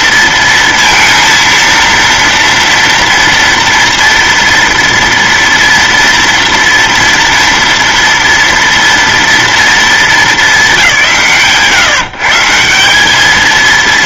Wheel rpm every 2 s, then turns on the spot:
230, 230, 230, 230, 230, 230, 150.
none